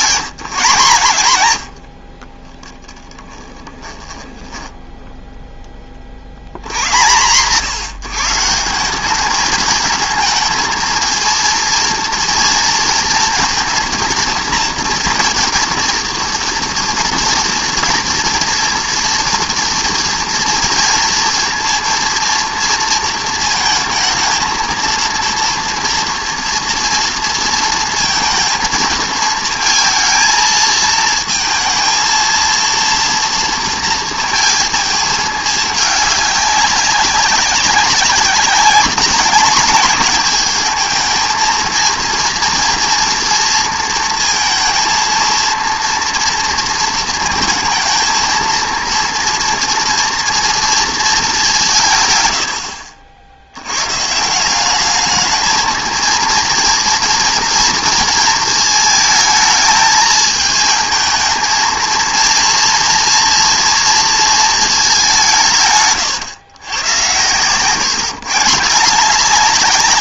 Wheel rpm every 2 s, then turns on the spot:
150, 10, 10, 110, 180, 230, 230, 230, 230, 230, 230, 230, 230, 230, 220, 230, 230, 220, 200, 200, 220, 230, 230, 230, 230, 230, 70, 200, 230, 220, 220, 230, 210, 120, 180.
2-6